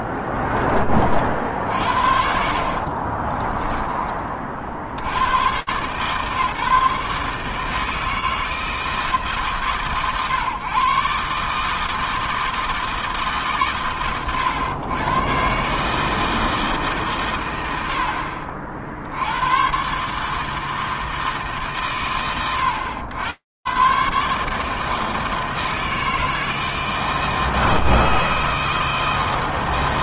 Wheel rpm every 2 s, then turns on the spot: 20, 60, 40, 150, 160, 120, 160, 100, 160, 30, 150, 70, 150, 160, 160.
2-4